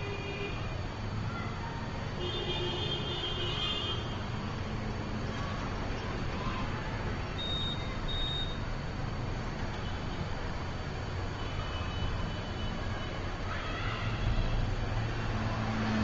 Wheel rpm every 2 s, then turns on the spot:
0, 0, 0, 0, 0, 0, 0, 0.
none